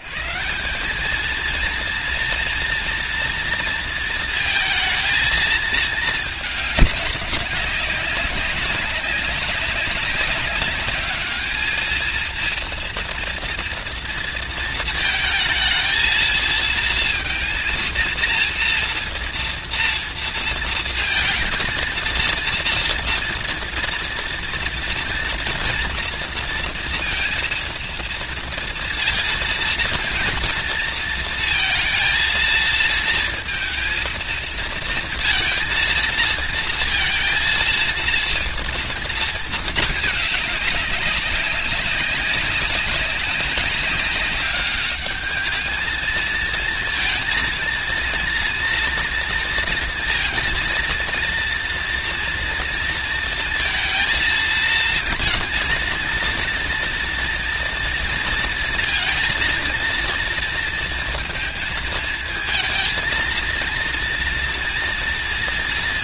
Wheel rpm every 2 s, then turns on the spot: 160, 230, 230, 210, 190, 200, 230, 230, 230, 230, 230, 230, 230, 230, 230, 230, 230, 230, 230, 230, 210, 200, 200, 220, 230, 230, 230, 230, 230, 230, 230, 230, 240.
none